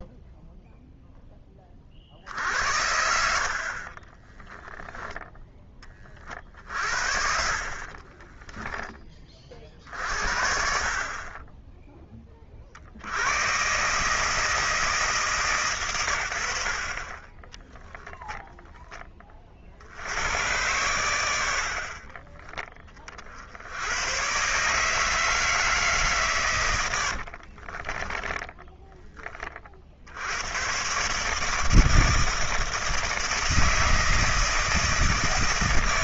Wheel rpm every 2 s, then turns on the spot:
0, 70, 10, 40, 20, 60, 30, 150, 80, 10, 90, 30, 130, 110, 10, 100, 160, 160.
4-6 8-10 22-24 28-30